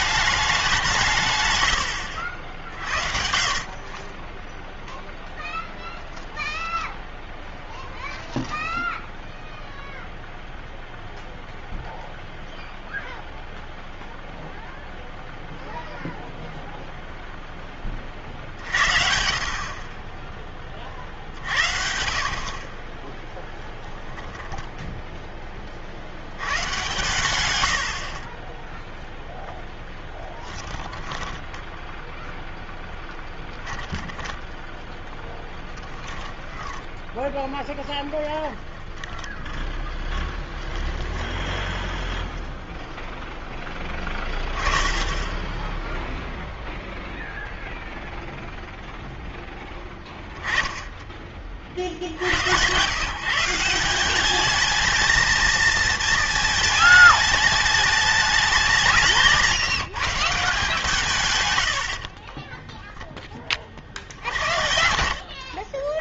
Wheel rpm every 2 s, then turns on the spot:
190, 60, 0, 20, 10, 0, 0, 0, 0, 60, 30, 40, 10, 120, 10, 10, 0, 10, 10, 20, 10, 0, 10, 0, 0, 10, 110, 210, 220, 190, 170, 10, 70.
24-26 30-32 38-40 62-64